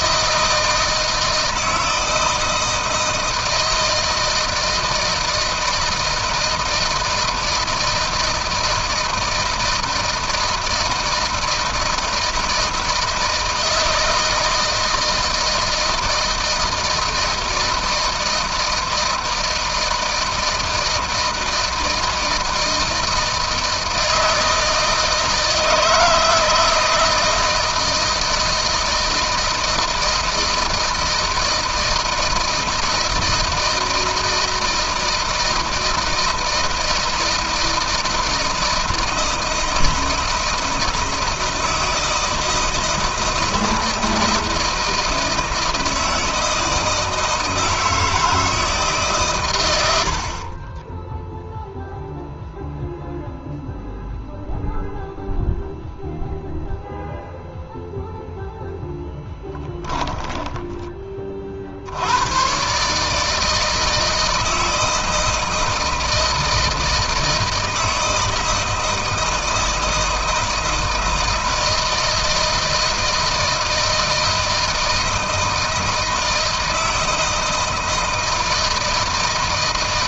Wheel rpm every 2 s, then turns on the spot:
160, 160, 160, 160, 160, 160, 160, 160, 160, 160, 160, 160, 160, 160, 160, 160, 160, 160, 160, 160, 160, 160, 160, 160, 150, 30, 0, 0, 0, 0, 20, 140, 160, 160, 160, 160, 160, 160, 160, 160.
50-52